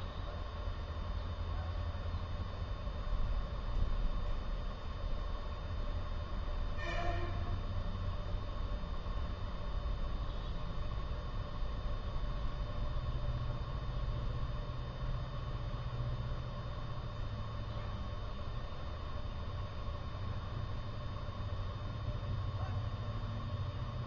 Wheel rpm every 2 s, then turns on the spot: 0, 0, 0, 0, 0, 0, 0, 0, 0, 0, 0, 0.
none